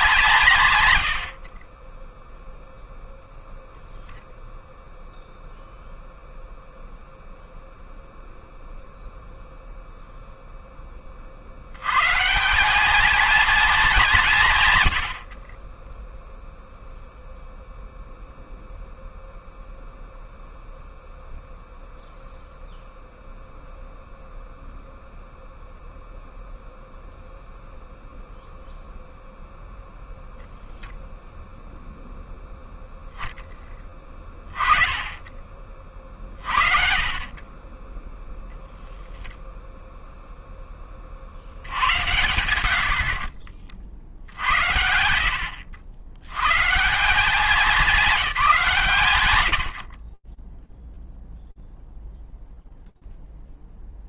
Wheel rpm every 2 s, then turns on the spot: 0, 0, 0, 0, 30, 220, 90, 0, 0, 0, 0, 0, 0, 0, 0, 0, 30, 50, 10, 10, 80, 80, 150, 170, 0, 0, 0.
none